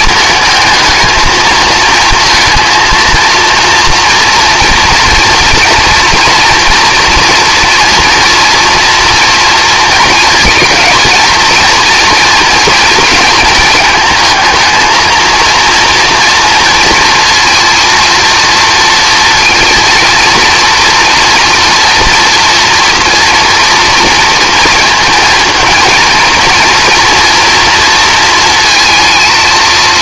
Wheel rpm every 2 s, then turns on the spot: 220, 230, 230, 240, 240, 230, 230, 230, 230, 230, 230, 230, 230, 230, 230.
none